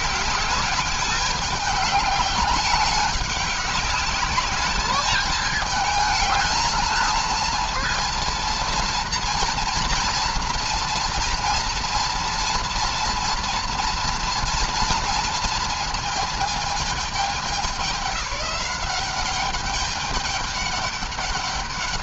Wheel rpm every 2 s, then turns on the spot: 210, 200, 200, 220, 230, 230, 230, 230, 220, 200, 200.
none